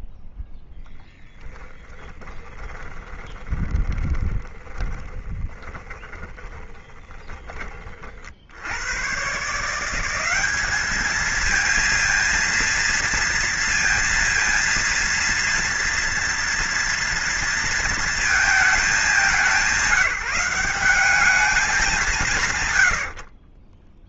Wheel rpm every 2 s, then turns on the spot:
0, 20, 20, 10, 60, 190, 230, 230, 230, 220, 190, 150.
2-8